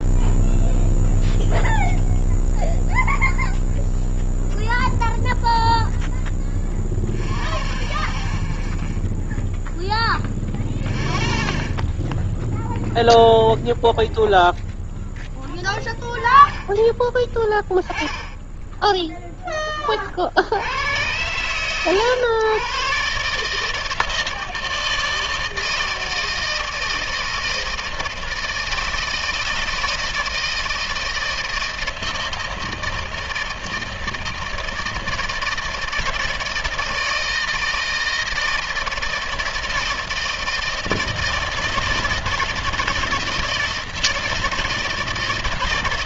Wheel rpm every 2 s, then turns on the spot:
0, 0, 0, 0, 0, 0, 0, 0, 10, 10, 90, 120, 160, 160, 160, 160, 160, 160, 160, 160, 160, 160, 160.
none